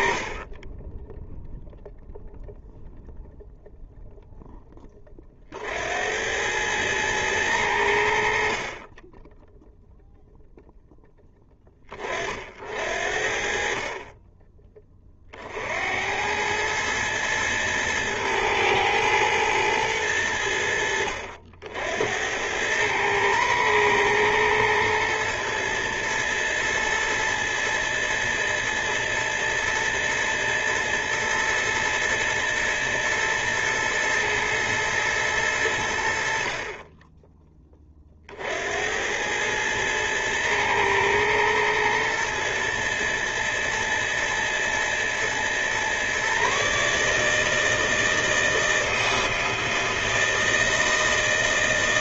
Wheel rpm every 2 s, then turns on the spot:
20, 0, 10, 100, 40, 0, 50, 20, 110, 110, 90, 100, 120, 110, 110, 110, 110, 110, 40, 70, 110, 110, 110, 140, 160, 160.
none